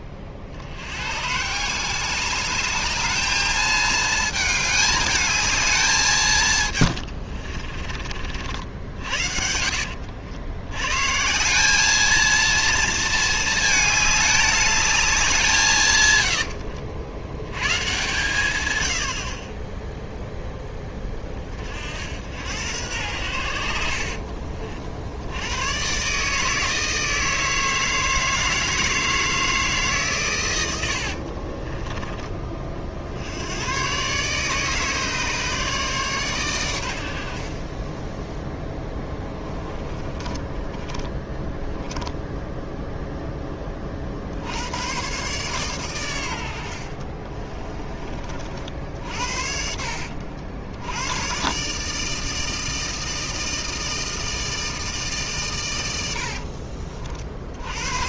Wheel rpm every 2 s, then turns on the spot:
50, 210, 210, 120, 70, 100, 230, 210, 80, 100, 10, 90, 60, 160, 160, 100, 30, 150, 110, 10, 20, 0, 100, 60, 50, 90, 160, 160, 50.
6-8 16-18 38-42 56-58